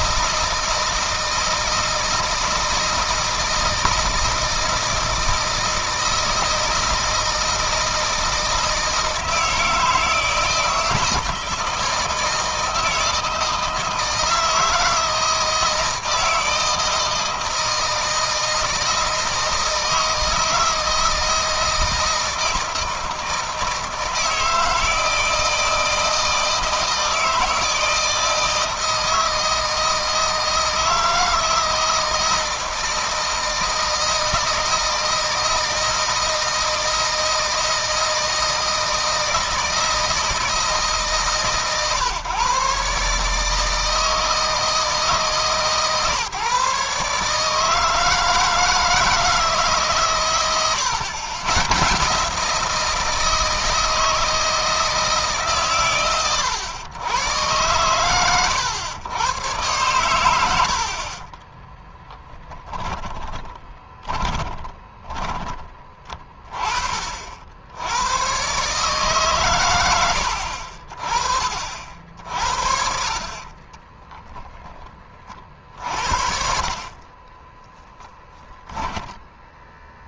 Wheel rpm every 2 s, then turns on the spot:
160, 160, 160, 160, 160, 160, 160, 160, 160, 160, 160, 160, 160, 160, 160, 160, 160, 160, 160, 160, 160, 140, 160, 140, 160, 110, 160, 160, 110, 110, 70, 10, 20, 30, 130, 50, 60, 20, 50, 10.
60-66 72-74